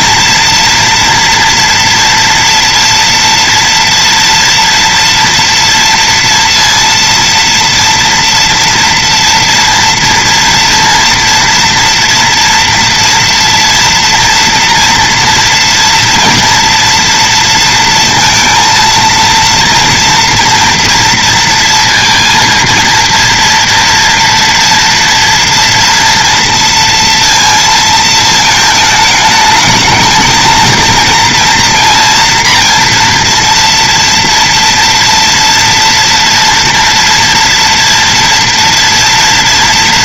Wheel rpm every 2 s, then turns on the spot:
230, 230, 230, 230, 230, 230, 230, 240, 230, 230, 230, 230, 230, 230, 220, 220, 240, 230, 230, 230.
none